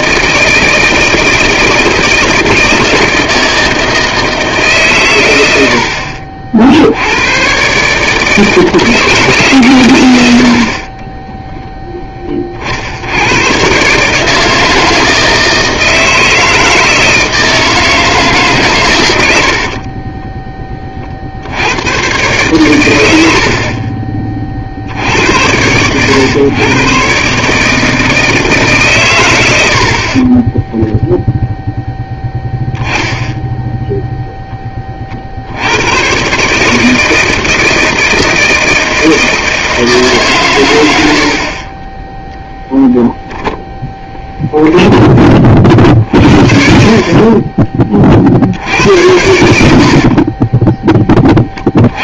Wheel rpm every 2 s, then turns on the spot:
160, 160, 140, 70, 160, 40, 60, 160, 160, 130, 20, 110, 50, 120, 150, 10, 0, 30, 150, 160, 110, 0, 10, 40, 70, 20.
30-32 46-48 50-52